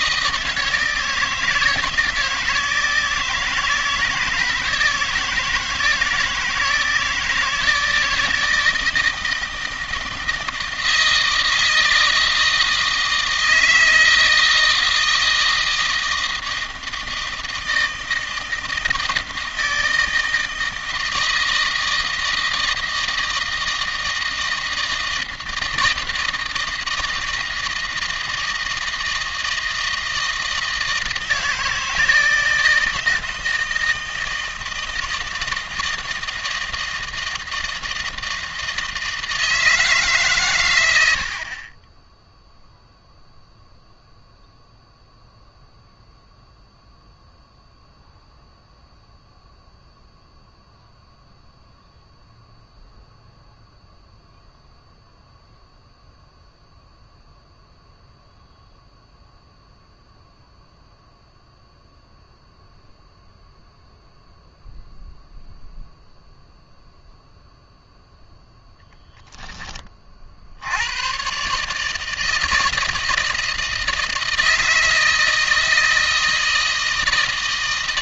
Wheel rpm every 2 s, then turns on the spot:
160, 160, 160, 160, 160, 160, 160, 160, 160, 160, 160, 160, 160, 160, 160, 160, 160, 160, 160, 160, 80, 0, 0, 0, 0, 0, 0, 0, 0, 0, 0, 0, 0, 0, 0, 100, 160, 160, 160.
none